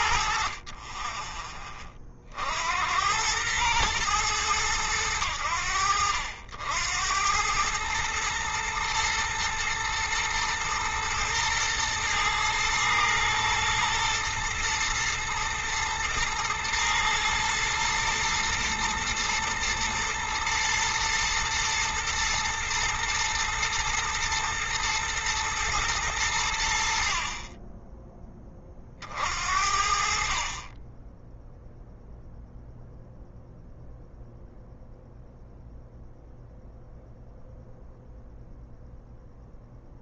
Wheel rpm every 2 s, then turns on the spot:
30, 80, 100, 80, 110, 110, 110, 120, 120, 110, 110, 120, 120, 70, 40, 20, 0, 0, 0, 0.
none